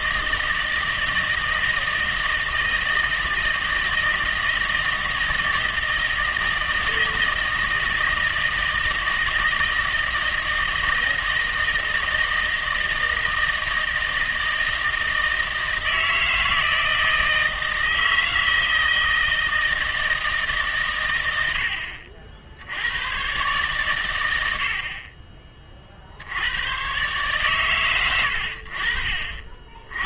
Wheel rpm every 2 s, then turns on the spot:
160, 160, 160, 160, 160, 160, 160, 160, 160, 160, 120, 100, 60, 110, 60.
none